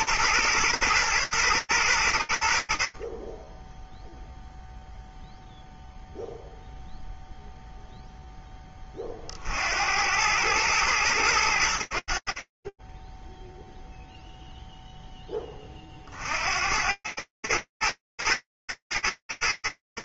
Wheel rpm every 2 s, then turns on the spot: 120, 40, 0, 0, 60, 110, 30, 0, 40, 110.
none